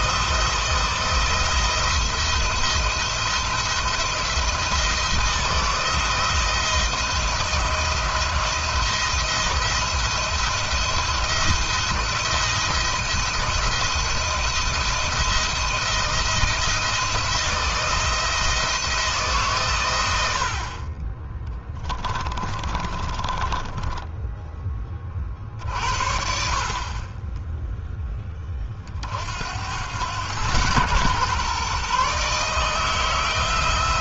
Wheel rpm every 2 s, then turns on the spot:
170, 170, 170, 170, 170, 170, 170, 170, 170, 160, 40, 30, 30, 30, 50, 120, 160.
22-24